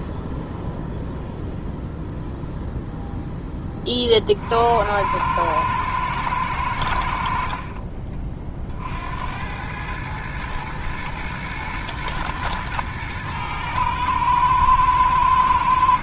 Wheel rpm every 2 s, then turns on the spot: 0, 0, 70, 100, 50, 110, 110, 110.
none